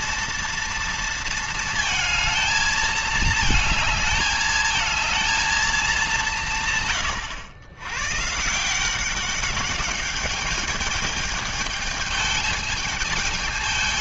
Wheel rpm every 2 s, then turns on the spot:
230, 220, 220, 170, 150, 210, 210.
none